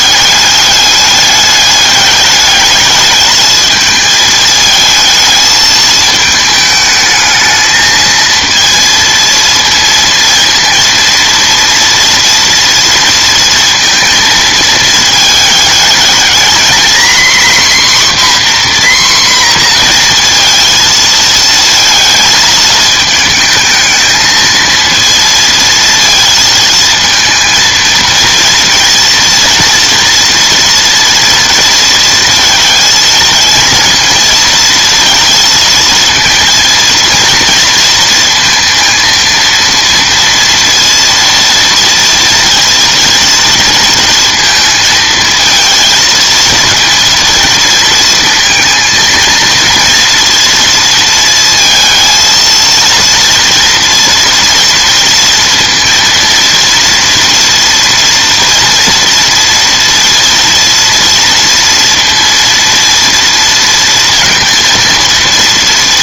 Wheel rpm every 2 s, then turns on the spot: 210, 220, 220, 220, 230, 230, 230, 220, 260, 250, 220, 220, 230, 220, 230, 230, 230, 230, 230, 230, 230, 230, 230, 230, 230, 230, 230, 230, 240, 230, 230, 230, 230.
none